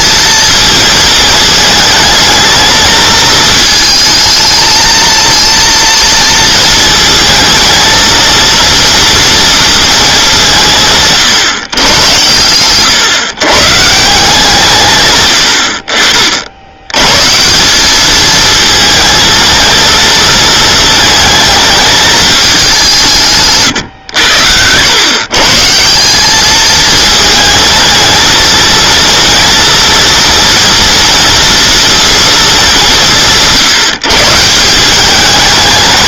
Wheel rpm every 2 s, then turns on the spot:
220, 220, 220, 220, 230, 170, 120, 140, 80, 220, 230, 190, 100, 220, 220, 230, 210, 170.
none